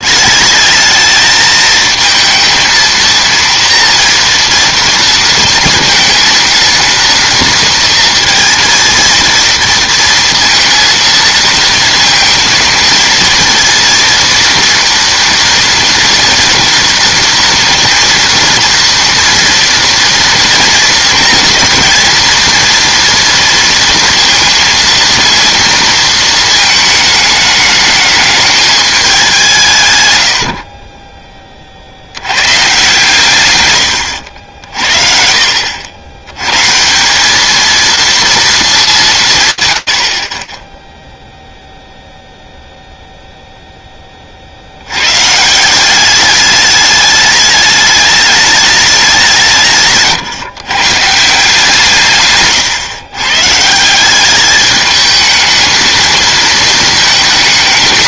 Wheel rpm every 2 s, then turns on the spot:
210, 230, 230, 230, 230, 230, 230, 230, 230, 230, 230, 230, 230, 220, 210, 50, 130, 70, 150, 200, 0, 0, 90, 210, 210, 140, 140, 210, 220.
none